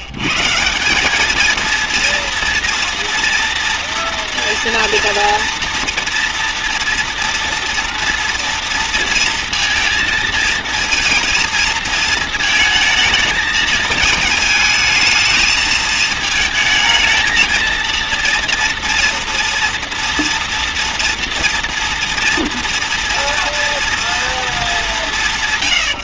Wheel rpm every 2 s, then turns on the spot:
170, 240, 240, 230, 230, 230, 220, 220, 220, 240, 240, 230, 220.
none